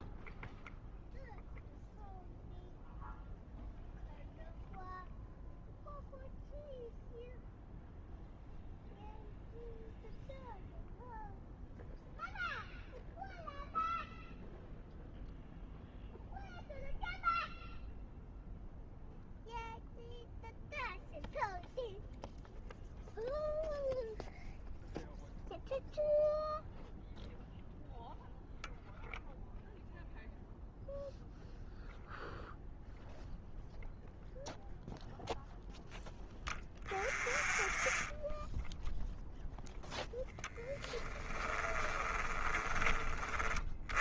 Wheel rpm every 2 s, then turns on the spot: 0, 0, 0, 0, 0, 0, 0, 0, 0, 0, 0, 0, 0, 0, 0, 0, 0, 0, 0, 0, 10, 30.
40-42